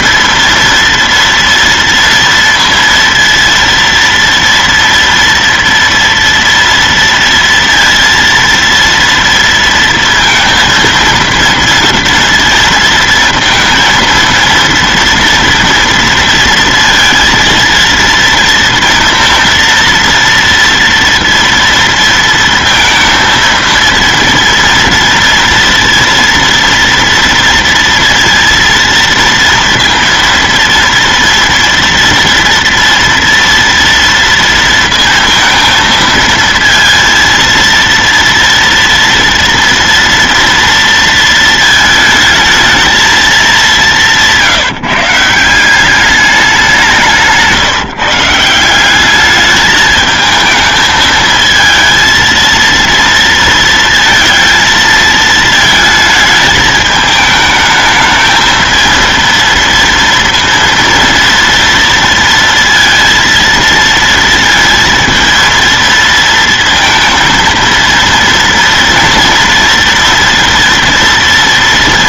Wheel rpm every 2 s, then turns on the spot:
230, 230, 230, 230, 230, 230, 230, 230, 230, 230, 230, 230, 230, 230, 230, 230, 240, 230, 230, 230, 230, 220, 170, 200, 160, 220, 230, 230, 220, 220, 230, 230, 230, 230, 230, 230.
none